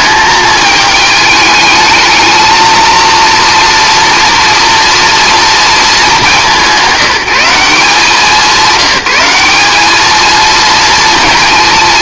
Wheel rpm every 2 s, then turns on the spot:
220, 220, 230, 180, 190, 230.
none